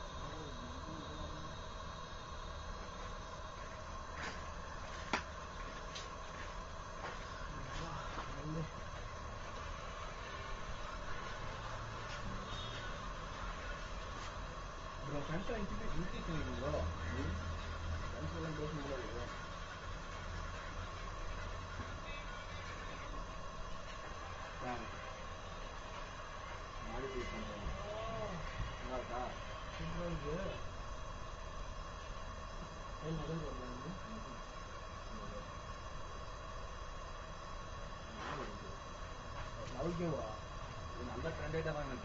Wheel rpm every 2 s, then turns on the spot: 0, 0, 0, 0, 0, 0, 0, 0, 0, 0, 0, 0, 0, 0, 0, 0, 0, 0, 0, 0, 0.
none